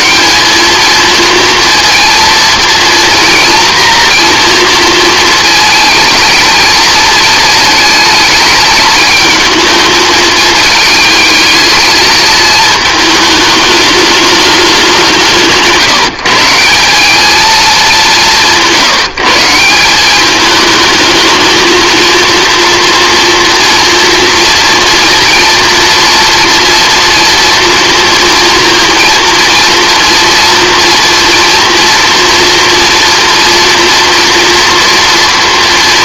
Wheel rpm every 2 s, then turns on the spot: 220, 230, 230, 220, 220, 220, 220, 200, 180, 160, 220, 240, 230, 240, 230, 240, 230, 240.
none